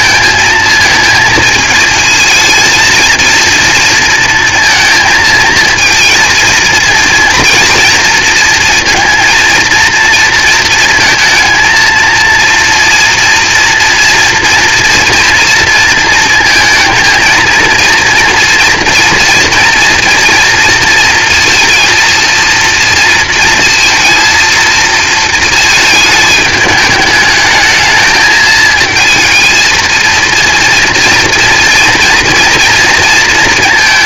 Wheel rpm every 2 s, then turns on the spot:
220, 230, 230, 230, 230, 220, 240, 240, 230, 230, 230, 230, 230, 220, 220, 230, 230.
none